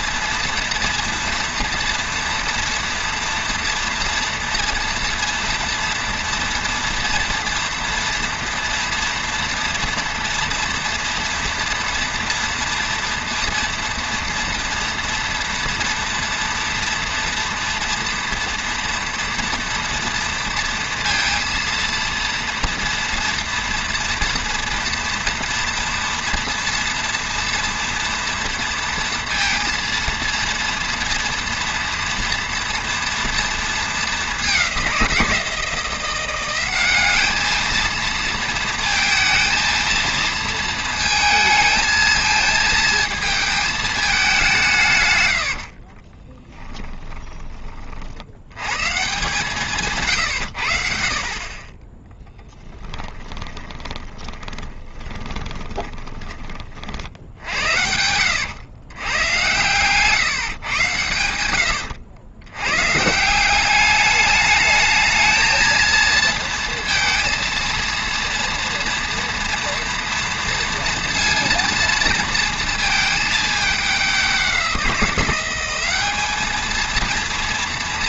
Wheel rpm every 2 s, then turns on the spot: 240, 230, 230, 230, 230, 230, 230, 230, 230, 230, 230, 230, 230, 230, 230, 230, 230, 180, 200, 230, 220, 220, 120, 20, 150, 50, 10, 20, 60, 110, 110, 160, 220, 230, 230, 230, 220, 180, 230.
46-48 52-56